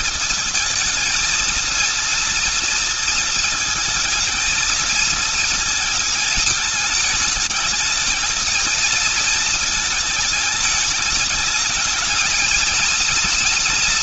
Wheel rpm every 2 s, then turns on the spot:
230, 230, 230, 220, 220, 210, 220.
none